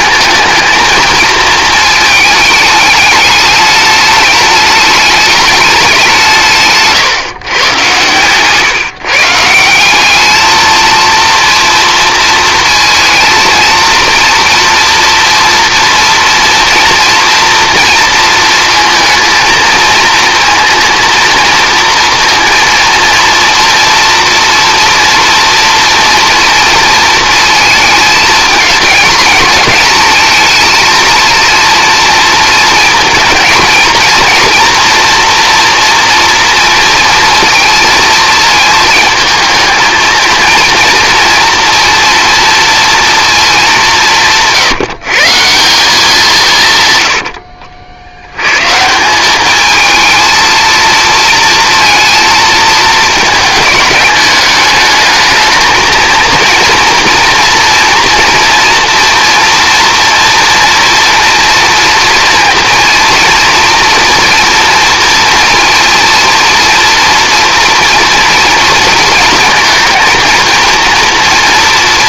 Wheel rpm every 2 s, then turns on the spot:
220, 210, 210, 150, 140, 220, 220, 230, 240, 230, 230, 230, 230, 230, 230, 230, 230, 230, 240, 220, 230, 230, 160, 130, 130, 230, 220, 210, 230, 230, 230, 230, 230, 230, 230, 230.
46-48